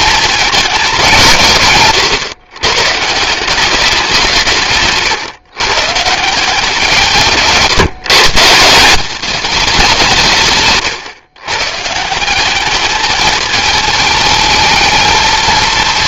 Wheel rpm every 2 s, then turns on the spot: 160, 160, 140, 160, 220, 130, 220, 220.
none